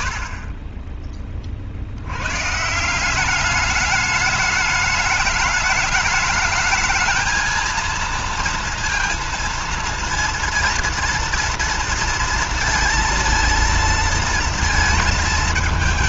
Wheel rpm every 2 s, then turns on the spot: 40, 150, 210, 220, 230, 230, 230, 230.
none